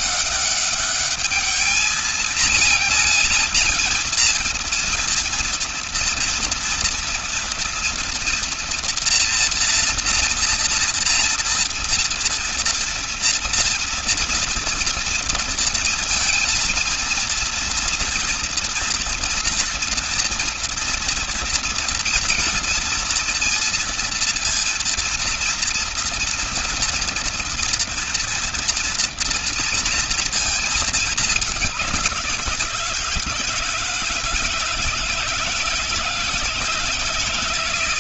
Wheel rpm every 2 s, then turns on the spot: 200, 230, 230, 230, 240, 230, 230, 230, 230, 230, 230, 230, 230, 230, 230, 220, 170, 160, 170.
none